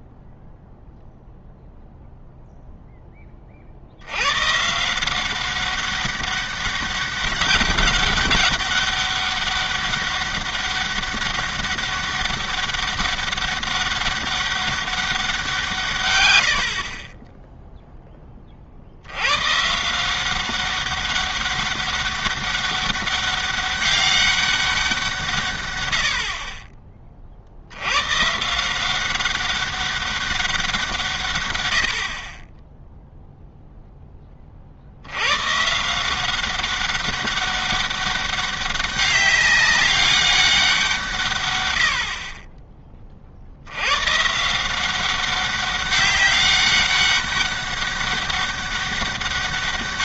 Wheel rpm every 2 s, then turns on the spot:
0, 0, 140, 200, 200, 200, 200, 200, 50, 50, 190, 200, 190, 20, 170, 180, 10, 50, 190, 200, 190, 20, 170, 200, 200.
none